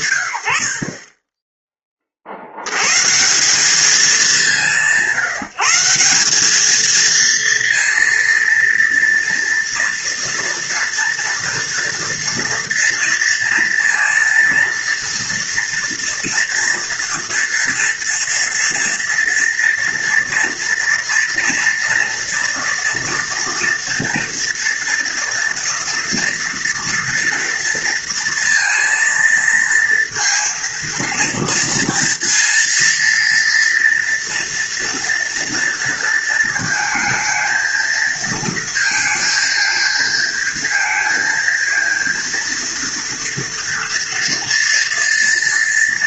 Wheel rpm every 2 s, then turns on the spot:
120, 40, 180, 210, 230, 230, 230, 230, 230, 230, 230, 230, 230, 230, 230, 230, 230, 230, 220, 230, 230, 230, 230.
none